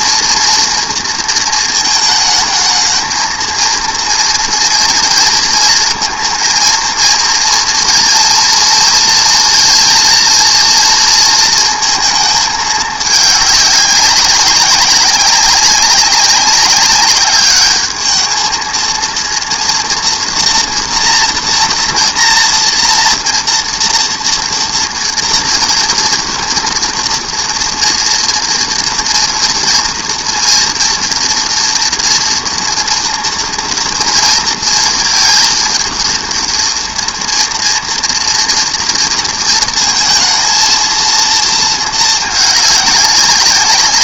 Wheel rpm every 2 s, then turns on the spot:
230, 220, 230, 230, 230, 240, 220, 200, 200, 220, 230, 230, 230, 230, 230, 230, 230, 230, 230, 230, 230, 210.
none